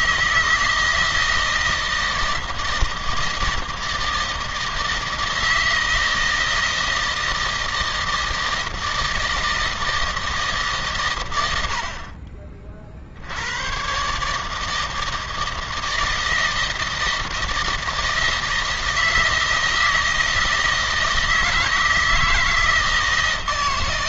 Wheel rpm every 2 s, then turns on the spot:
160, 160, 160, 160, 160, 140, 50, 160, 160, 160, 160, 160.
none